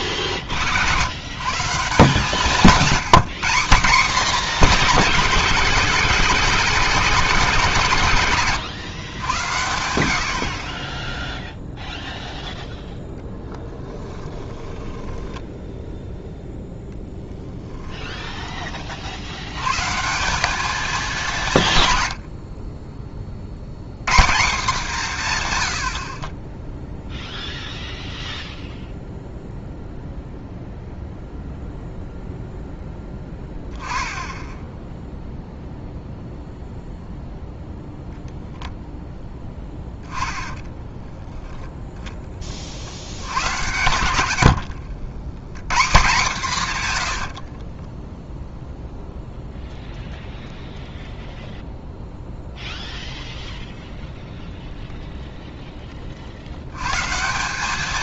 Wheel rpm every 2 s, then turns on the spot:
60, 170, 210, 190, 110, 40, 0, 10, 0, 20, 200, 40, 170, 10, 0, 0, 0, 10, 0, 0, 10, 40, 80, 130, 0, 0, 0, 0, 90.
14-16 40-42 44-46